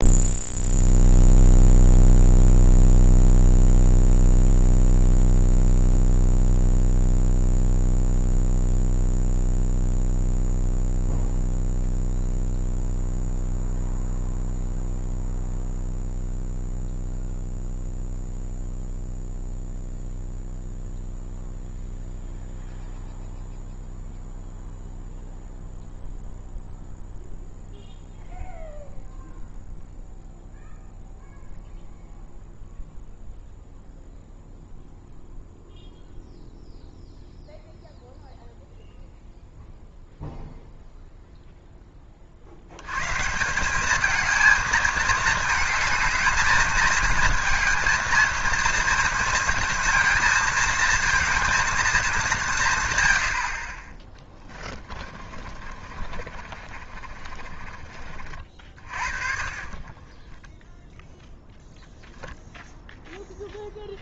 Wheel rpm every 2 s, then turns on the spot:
0, 0, 0, 0, 0, 0, 0, 0, 0, 0, 0, 0, 0, 0, 0, 0, 0, 0, 0, 0, 0, 130, 220, 220, 230, 230, 90, 30, 30, 40, 0, 0.
54-60